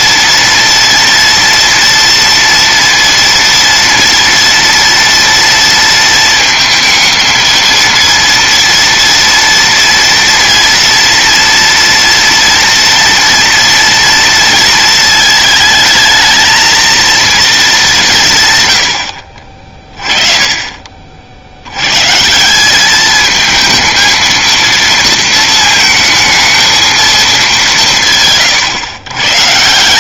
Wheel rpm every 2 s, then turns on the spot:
230, 230, 230, 230, 230, 230, 230, 230, 230, 140, 30, 180, 230, 220, 140.
none